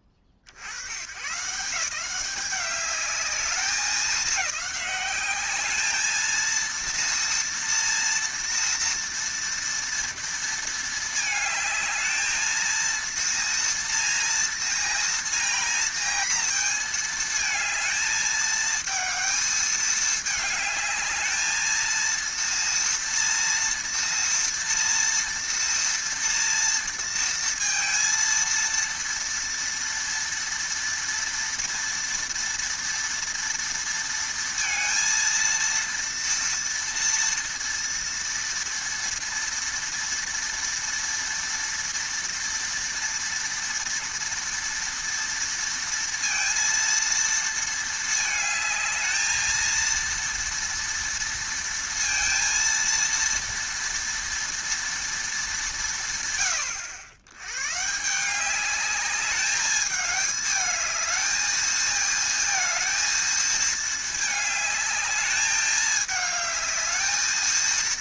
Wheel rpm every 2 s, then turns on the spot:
100, 200, 200, 230, 230, 220, 220, 230, 230, 220, 210, 230, 230, 230, 230, 230, 230, 230, 230, 230, 230, 230, 230, 230, 220, 230, 230, 230, 110, 200, 220, 220, 210, 220.
none